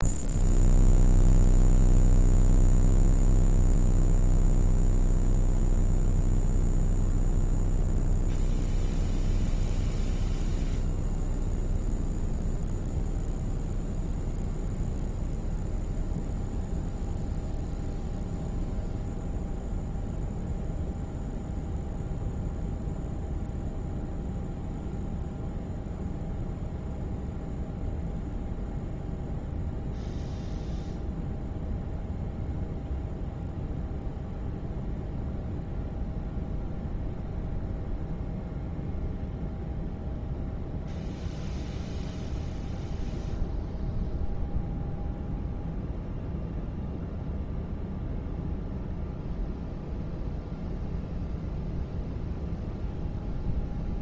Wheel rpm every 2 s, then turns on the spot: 0, 0, 0, 0, 0, 0, 0, 0, 0, 0, 0, 0, 0, 0, 0, 0, 0, 0, 0, 0, 0, 0, 0, 0, 0, 0, 0.
none